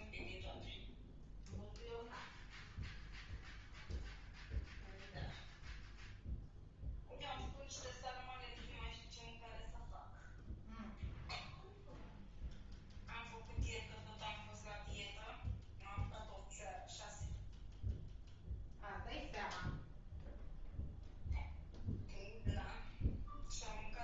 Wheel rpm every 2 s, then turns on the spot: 0, 0, 0, 0, 0, 0, 0, 0, 0, 0, 0, 0.
none